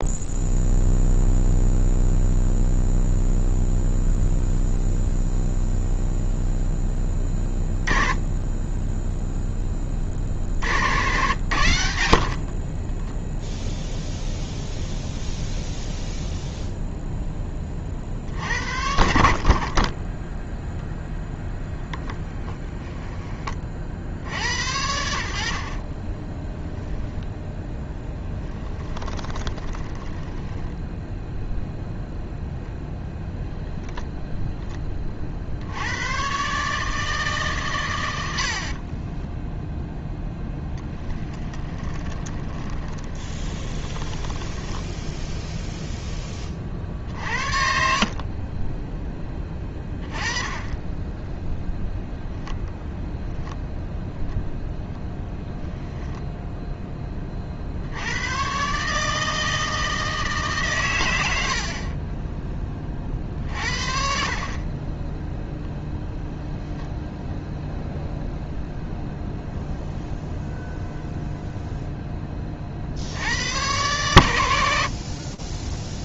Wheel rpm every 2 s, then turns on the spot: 0, 0, 0, 0, 10, 60, 50, 0, 0, 60, 0, 0, 80, 20, 10, 10, 0, 10, 130, 70, 10, 20, 10, 30, 20, 20, 0, 0, 10, 120, 150, 20, 40, 0, 0, 0, 30, 100.
12-14 26-32 40-46